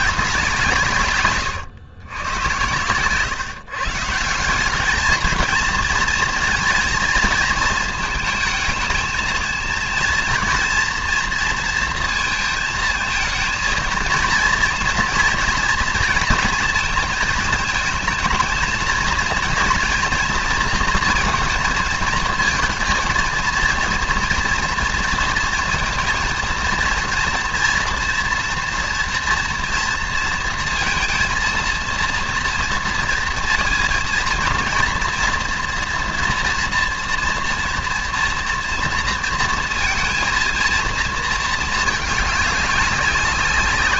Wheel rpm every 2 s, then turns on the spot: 160, 110, 190, 230, 220, 230, 230, 240, 230, 220, 230, 230, 230, 230, 230, 230, 230, 230, 240, 230, 230, 200.
none